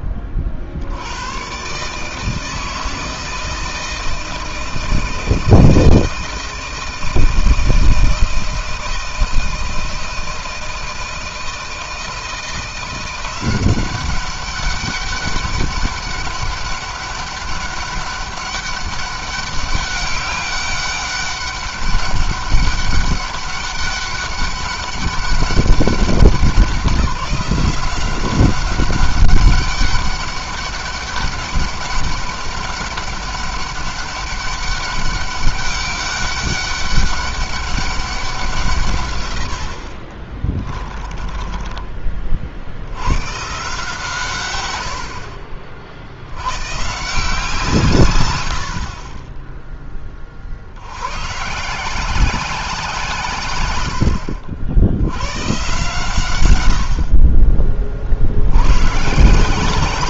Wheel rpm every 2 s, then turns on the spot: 60, 160, 160, 160, 160, 160, 170, 200, 200, 200, 200, 200, 200, 190, 190, 200, 200, 200, 200, 150, 20, 60, 100, 130, 60, 70, 170, 70, 70, 130.
40-42